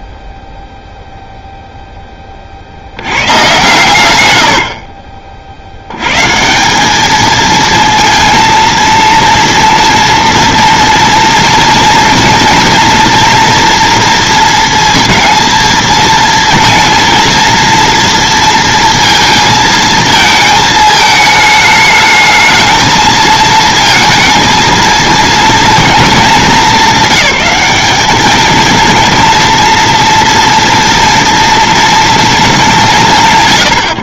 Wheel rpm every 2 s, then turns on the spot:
0, 70, 60, 190, 230, 230, 230, 230, 230, 230, 220, 220, 230, 200, 230, 230, 210.
none